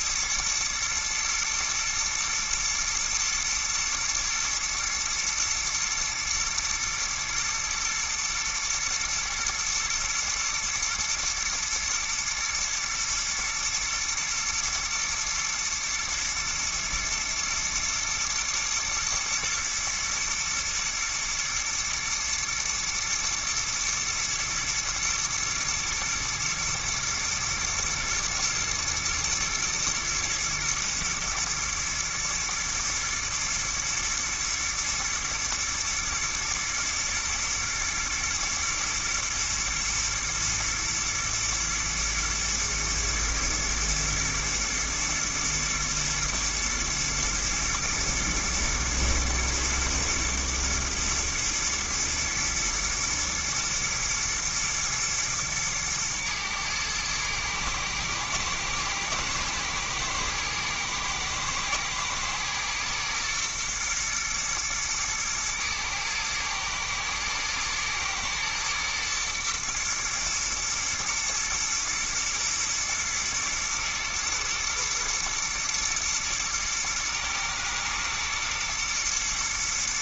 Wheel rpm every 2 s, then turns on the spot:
120, 120, 120, 120, 120, 120, 120, 120, 120, 120, 120, 120, 110, 110, 110, 110, 120, 110, 120, 110, 120, 110, 120, 120, 110, 110, 110, 110, 110, 120, 110, 120, 110, 110, 120, 110, 120, 120, 120, 110.
none